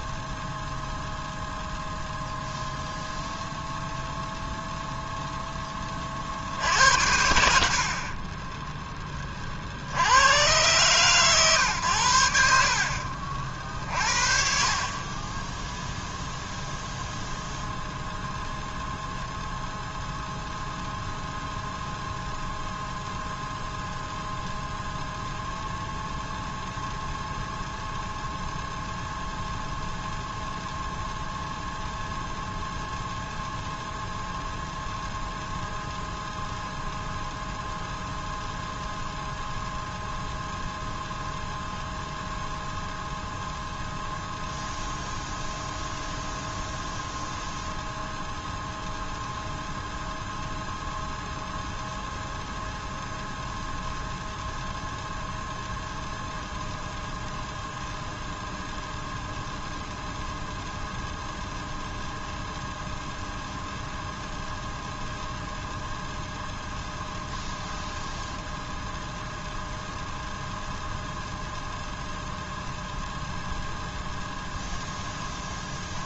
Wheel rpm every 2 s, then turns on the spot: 0, 0, 0, 70, 10, 130, 60, 40, 0, 0, 0, 0, 0, 0, 0, 0, 0, 0, 0, 0, 0, 0, 0, 0, 0, 0, 0, 0, 0, 0, 0, 0, 0, 0, 0, 0, 0, 0.
none